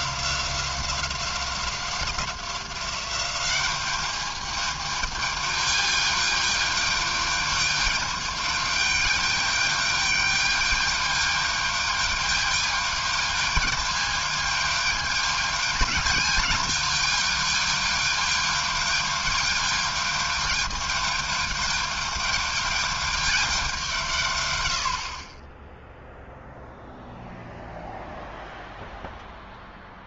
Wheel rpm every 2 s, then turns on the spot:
180, 180, 210, 210, 210, 210, 210, 210, 210, 210, 210, 210, 110, 0, 0.
none